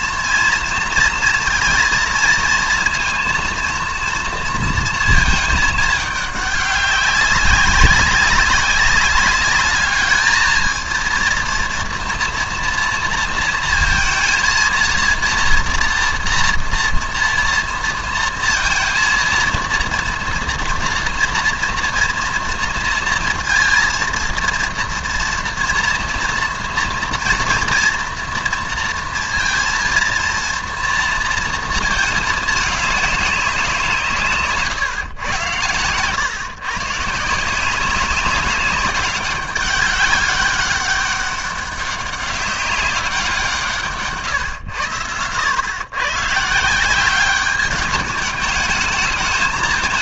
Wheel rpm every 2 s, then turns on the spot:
230, 230, 230, 200, 200, 230, 230, 230, 240, 230, 230, 230, 230, 230, 230, 230, 210, 130, 140, 200, 200, 190, 110, 170, 210.
none